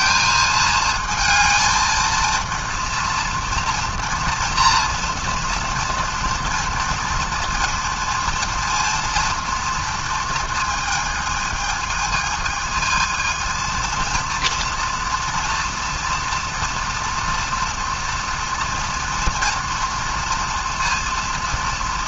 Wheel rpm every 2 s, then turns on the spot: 220, 230, 230, 230, 230, 220, 220, 230, 230, 240, 230.
none